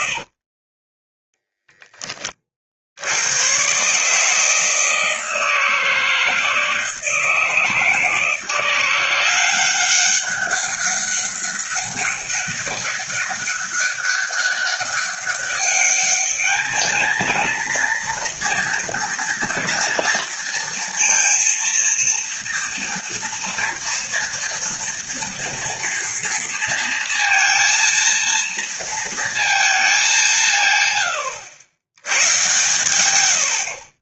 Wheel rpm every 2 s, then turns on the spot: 20, 70, 160, 160, 170, 200, 200, 200, 220, 240, 230, 240, 240, 230, 230, 130, 110.
0-2 32-34